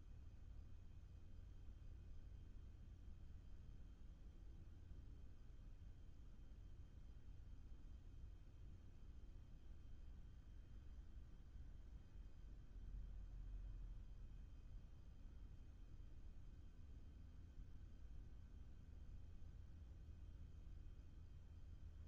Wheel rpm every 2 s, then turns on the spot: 0, 0, 0, 0, 0, 0, 0, 0, 0, 0, 0.
none